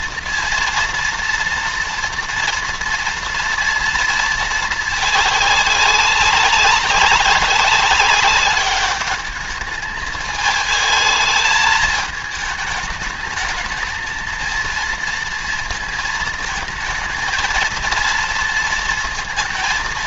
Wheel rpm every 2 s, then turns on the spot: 230, 230, 220, 190, 200, 210, 210, 230, 220, 230.
none